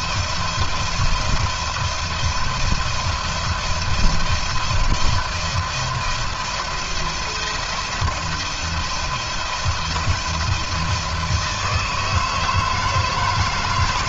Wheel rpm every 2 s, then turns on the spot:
170, 170, 170, 170, 170, 170, 160.
none